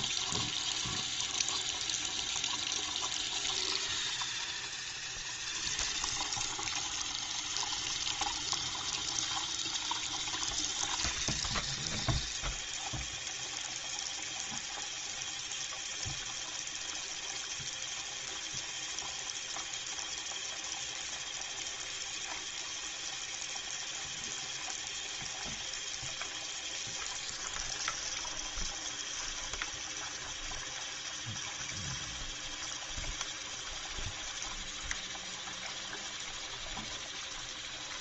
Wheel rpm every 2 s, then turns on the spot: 0, 0, 0, 0, 0, 0, 0, 0, 0, 0, 0, 0, 0, 0, 0, 0, 0, 0, 0.
none